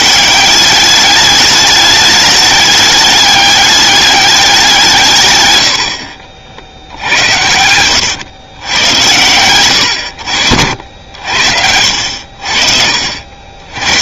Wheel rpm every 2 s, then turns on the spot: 200, 210, 170, 80, 100, 70, 60.
10-12